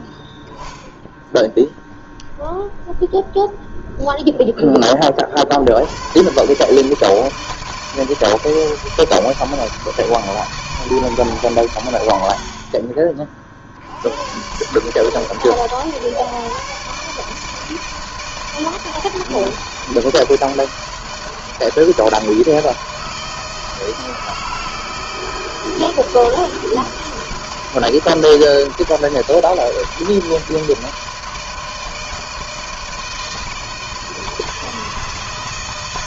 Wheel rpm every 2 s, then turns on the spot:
0, 0, 10, 130, 160, 160, 60, 120, 140, 160, 160, 160, 160, 160, 160, 160, 160, 160.
none